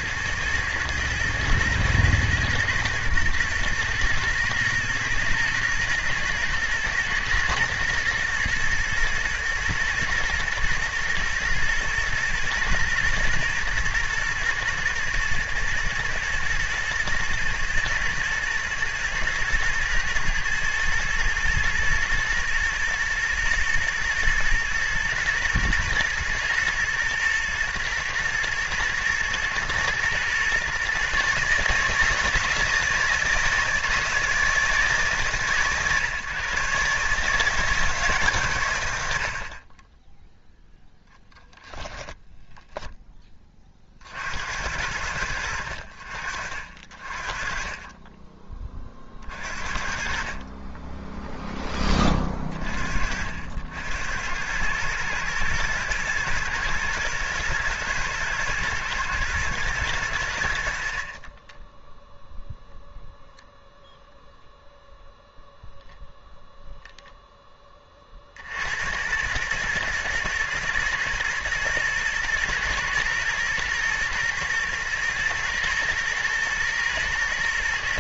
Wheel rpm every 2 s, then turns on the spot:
110, 120, 110, 110, 120, 110, 120, 110, 110, 110, 110, 110, 110, 110, 110, 130, 160, 150, 140, 100, 0, 0, 80, 60, 40, 20, 40, 110, 110, 110, 80, 0, 0, 0, 90, 120, 120, 120, 110.
none